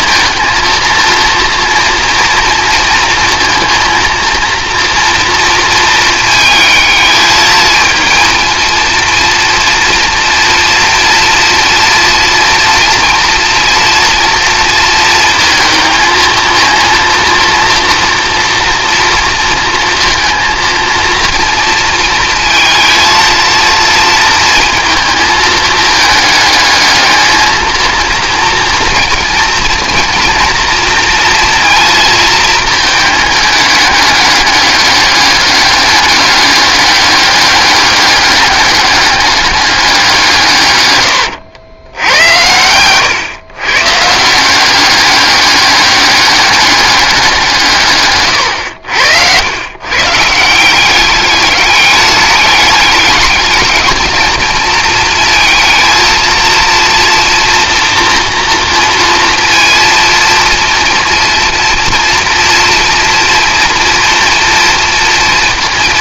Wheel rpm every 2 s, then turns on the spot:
230, 230, 240, 220, 230, 230, 230, 230, 230, 230, 230, 230, 220, 220, 230, 240, 230, 200, 200, 200, 130, 100, 190, 200, 110, 180, 210, 230, 230, 230, 240, 230, 230.
none